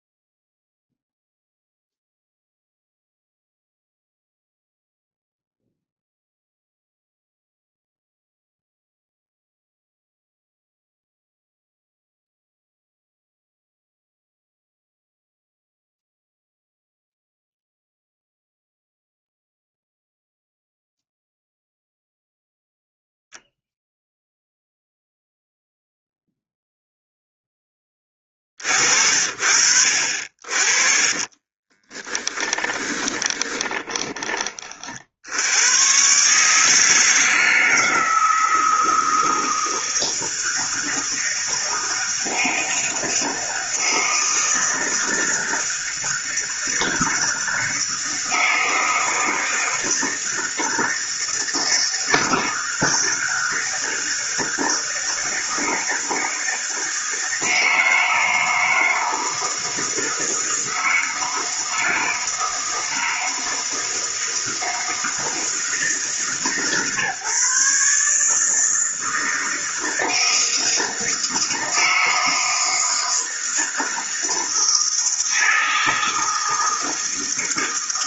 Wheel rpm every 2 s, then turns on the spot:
0, 0, 0, 0, 0, 0, 0, 0, 0, 0, 0, 0, 0, 0, 40, 40, 20, 40, 150, 160, 160, 160, 160, 160, 160, 160, 160, 160, 160, 160, 160, 160, 160, 150, 160, 160, 160, 160, 160.
30-34